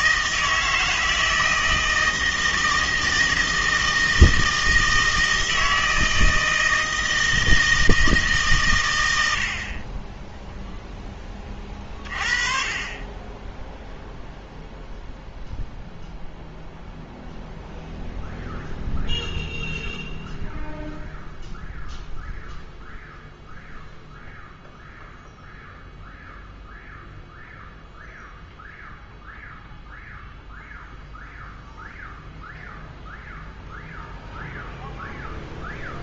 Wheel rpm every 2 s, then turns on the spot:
160, 160, 160, 160, 130, 0, 30, 0, 0, 0, 0, 0, 0, 0, 0, 0, 0, 0.
none